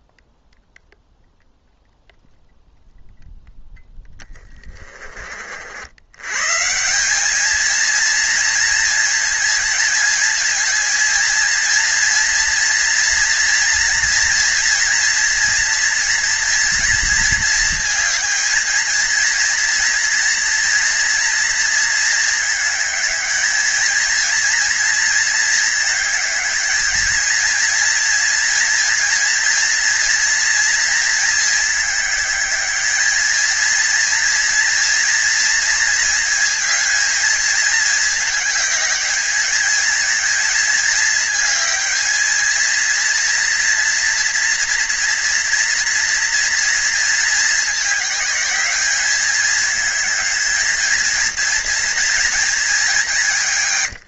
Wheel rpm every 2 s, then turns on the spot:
0, 0, 40, 180, 230, 220, 230, 230, 220, 230, 230, 210, 220, 220, 230, 220, 210, 230, 220, 210, 220, 230, 230, 220, 200, 230, 190.
none